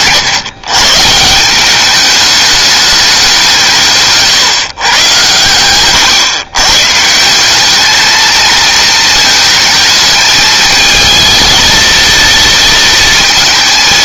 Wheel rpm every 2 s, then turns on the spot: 150, 210, 110, 150, 220, 220, 230.
none